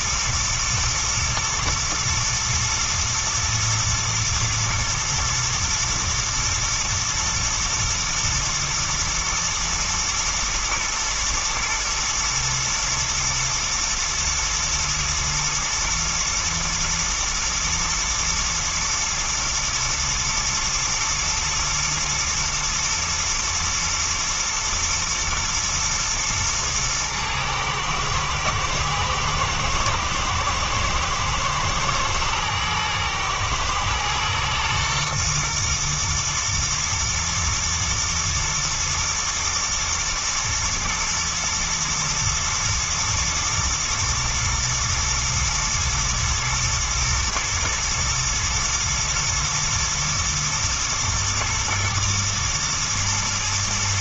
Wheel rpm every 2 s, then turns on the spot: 110, 110, 120, 110, 120, 110, 120, 110, 110, 110, 120, 110, 110, 110, 110, 110, 110, 120, 110, 120, 120, 120, 120, 110, 110, 110, 110.
none